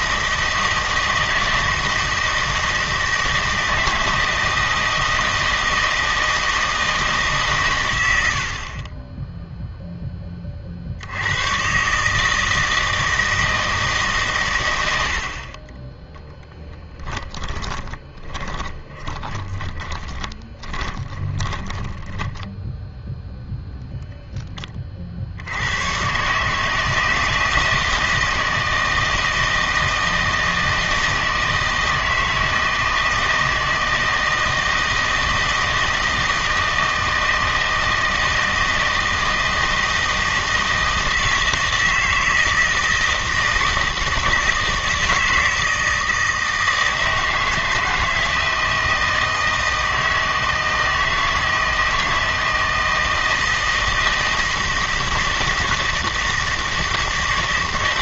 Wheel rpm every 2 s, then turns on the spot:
160, 160, 160, 160, 40, 60, 160, 90, 10, 30, 20, 10, 20, 160, 160, 160, 160, 160, 160, 160, 160, 160, 160, 160, 160, 160, 160, 160, 160.
16-22